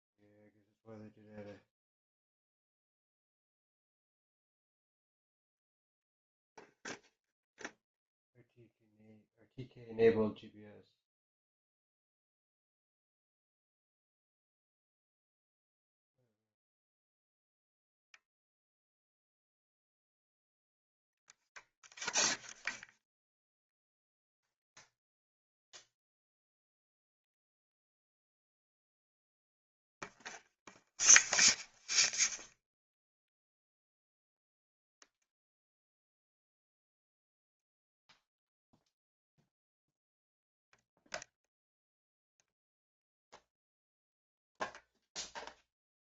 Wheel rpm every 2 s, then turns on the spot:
0, 0, 0, 0, 0, 0, 0, 0, 0, 0, 0, 0, 0, 0, 0, 0, 0, 0, 0, 0, 0, 0, 0.
none